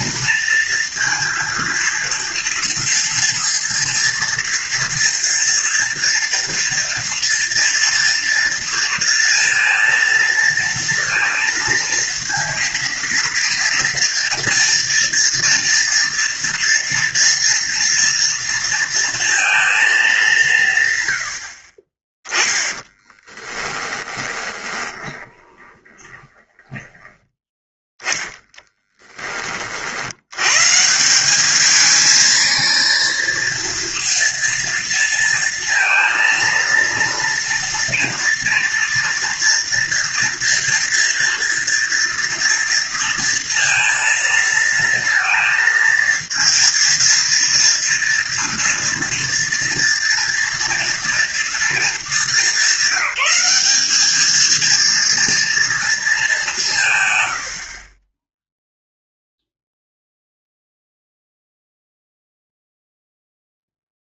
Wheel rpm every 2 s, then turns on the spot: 230, 240, 230, 230, 230, 230, 230, 240, 240, 230, 150, 10, 20, 20, 10, 120, 220, 230, 230, 230, 230, 230, 230, 230, 230, 230, 200, 230, 180, 0, 0, 0.
22-30